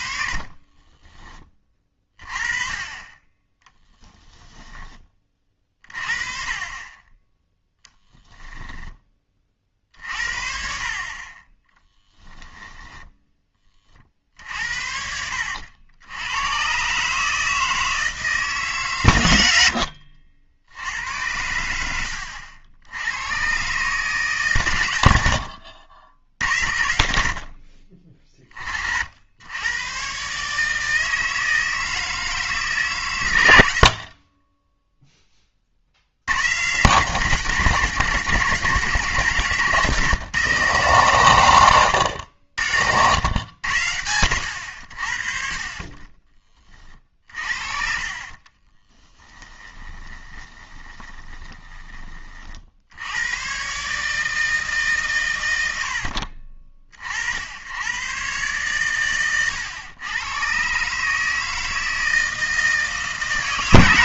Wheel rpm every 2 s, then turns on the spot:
30, 30, 10, 30, 10, 50, 20, 60, 110, 150, 70, 70, 120, 80, 40, 150, 150, 20, 130, 160, 150, 80, 90, 30, 30, 20, 50, 150, 40, 120, 130, 160.
0-2 8-10 12-14 34-36 48-52